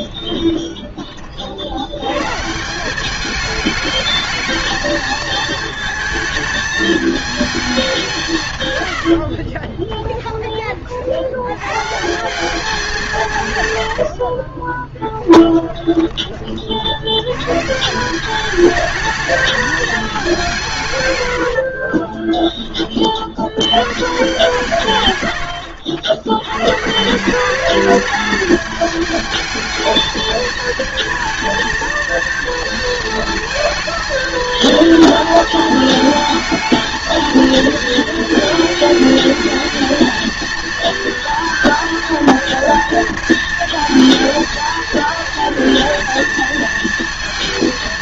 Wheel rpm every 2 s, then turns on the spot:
20, 180, 220, 210, 110, 30, 190, 20, 50, 210, 160, 20, 140, 130, 210, 220, 230, 230, 220, 220, 230, 230, 230, 230.
8-10 14-16